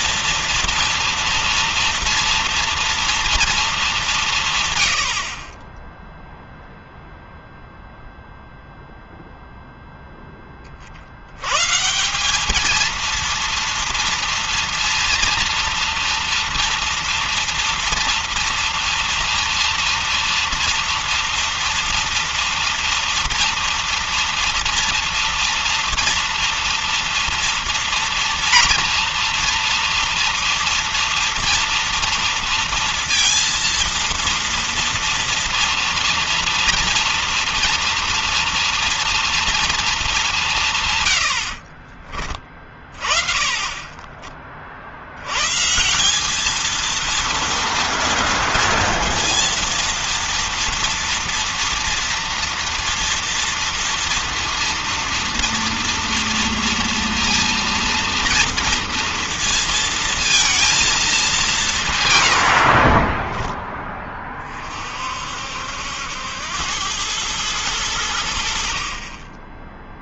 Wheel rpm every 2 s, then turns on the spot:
230, 230, 150, 0, 0, 10, 190, 230, 230, 230, 230, 230, 230, 230, 230, 230, 230, 230, 230, 240, 180, 30, 40, 200, 230, 230, 230, 230, 230, 230, 230, 90, 30, 90, 80.
none